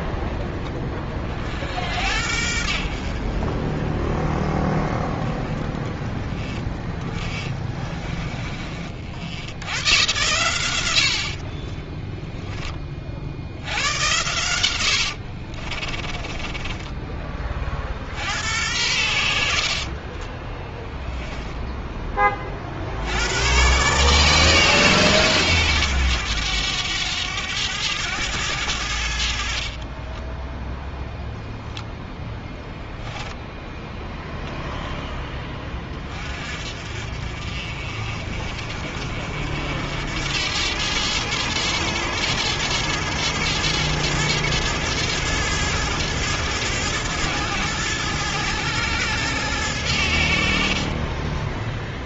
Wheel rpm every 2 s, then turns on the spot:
10, 60, 10, 10, 40, 100, 10, 90, 20, 80, 10, 40, 140, 100, 100, 0, 0, 0, 40, 50, 90, 110, 110, 110, 110, 50.
16-18 20-22